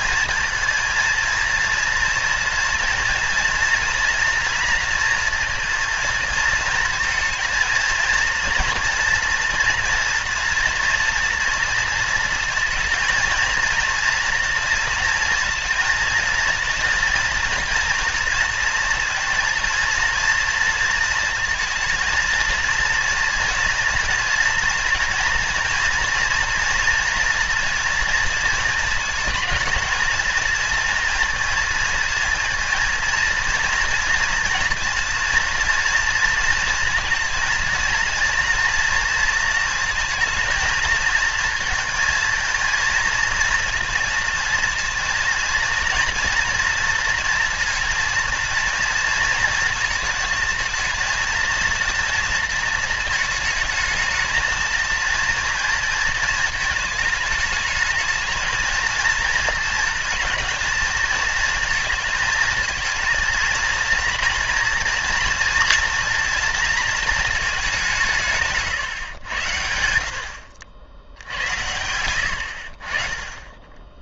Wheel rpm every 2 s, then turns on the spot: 230, 230, 230, 230, 230, 230, 230, 230, 230, 230, 230, 230, 240, 230, 220, 220, 230, 230, 230, 230, 230, 220, 230, 230, 230, 230, 230, 220, 220, 230, 220, 230, 230, 230, 140, 80, 60.
none